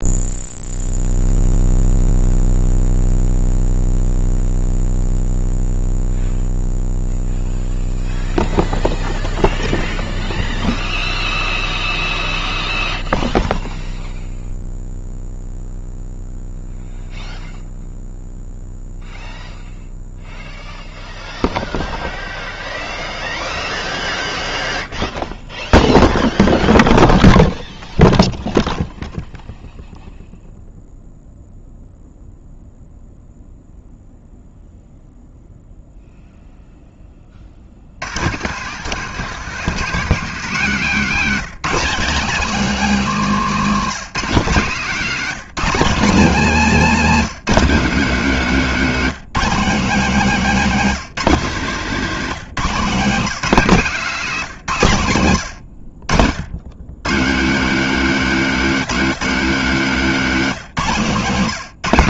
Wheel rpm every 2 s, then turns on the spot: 0, 0, 0, 0, 0, 0, 0, 0, 0, 0, 0, 0, 0, 0, 0, 0, 0, 0, 10, 150, 200, 220, 190, 200, 190, 190, 180, 140, 130, 250, 180.
none